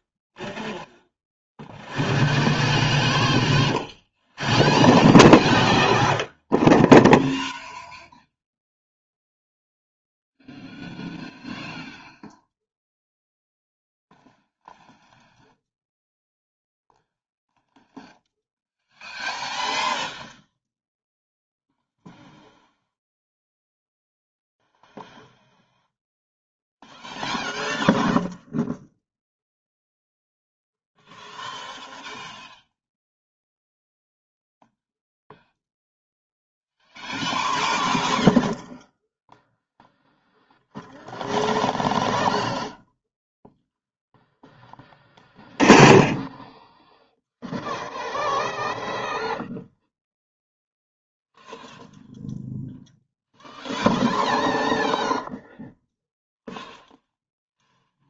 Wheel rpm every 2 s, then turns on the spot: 0, 0, 0, 0, 0, 0, 0, 0, 0, 0, 0, 0, 0, 0, 0, 0, 0, 0, 0, 0, 0, 0, 10, 10, 0, 0, 0, 0, 0.
none